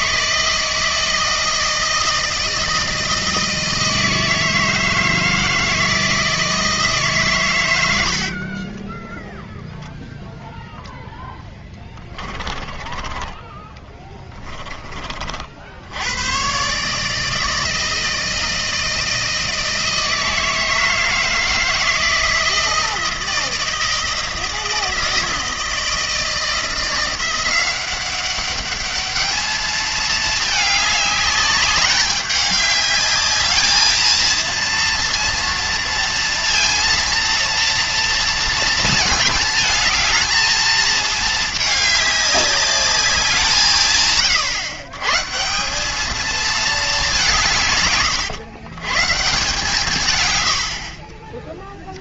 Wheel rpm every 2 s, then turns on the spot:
160, 160, 160, 160, 20, 0, 20, 20, 140, 160, 160, 160, 160, 170, 210, 210, 210, 230, 230, 230, 220, 200, 130, 220, 120, 60.
8-10 12-14